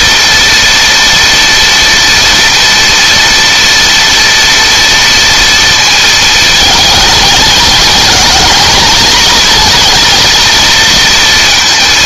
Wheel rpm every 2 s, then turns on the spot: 230, 230, 230, 220, 230, 230.
none